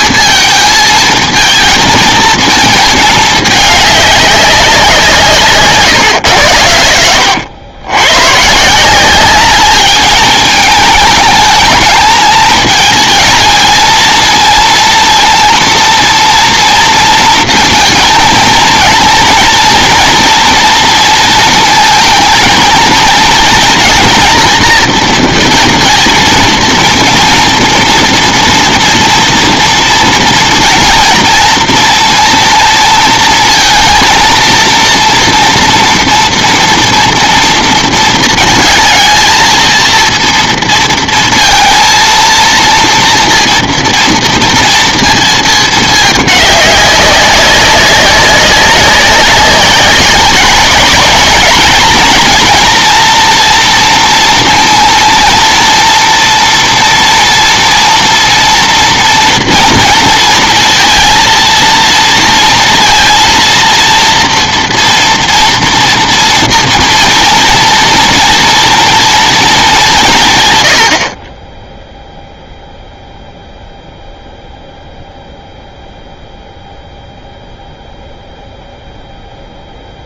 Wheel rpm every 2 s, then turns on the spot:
220, 220, 190, 80, 170, 220, 220, 230, 230, 230, 230, 220, 230, 230, 230, 230, 230, 230, 230, 230, 230, 230, 230, 200, 190, 200, 240, 230, 230, 230, 230, 230, 230, 230, 230, 80, 0, 0, 0, 0.
none